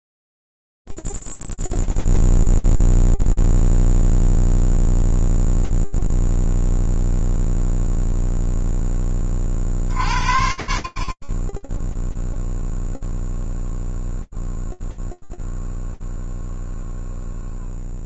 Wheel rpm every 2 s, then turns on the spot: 0, 0, 0, 0, 0, 50, 0, 0, 0.
none